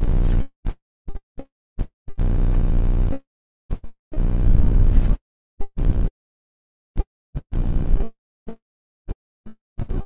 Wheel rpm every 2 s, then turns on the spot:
0, 0, 0, 0, 0.
none